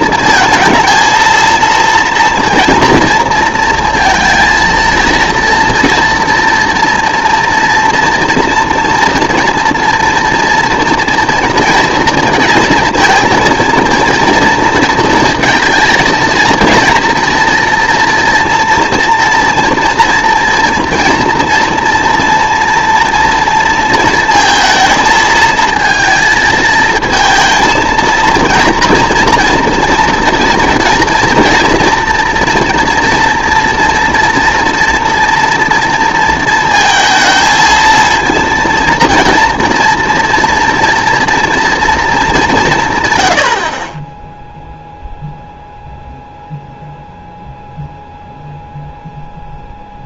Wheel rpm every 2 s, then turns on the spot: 230, 230, 230, 230, 230, 230, 230, 230, 230, 230, 230, 230, 230, 220, 230, 240, 230, 230, 230, 230, 240, 180, 0, 0, 0.
none